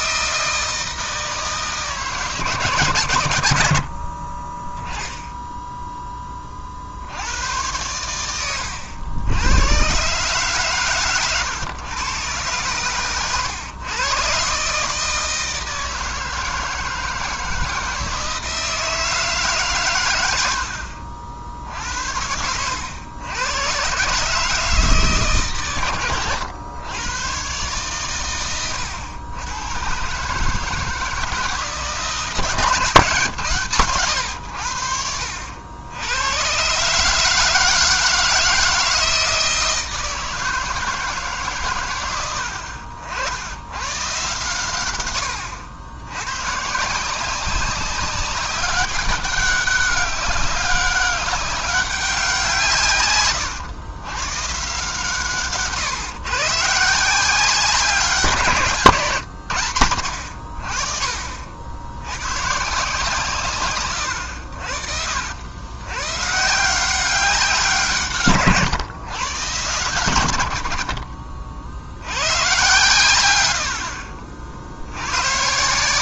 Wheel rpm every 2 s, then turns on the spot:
160, 130, 10, 70, 80, 130, 120, 150, 160, 160, 70, 90, 150, 100, 90, 160, 140, 80, 140, 160, 160, 60, 100, 170, 200, 200, 140, 140, 150, 150, 50, 140, 60, 180, 120, 50, 110, 80.
none